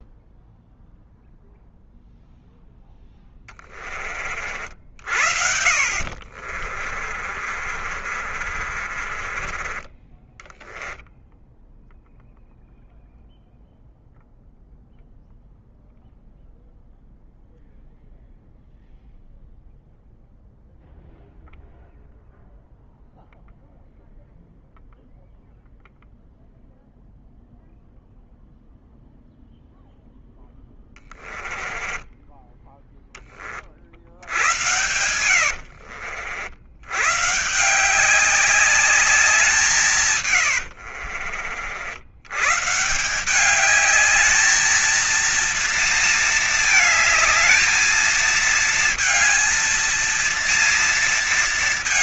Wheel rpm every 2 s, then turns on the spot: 0, 0, 50, 50, 40, 20, 0, 0, 0, 0, 0, 0, 0, 0, 0, 10, 10, 90, 90, 190, 90, 130, 220, 220, 230, 230.
6-12 30-32 34-36 40-42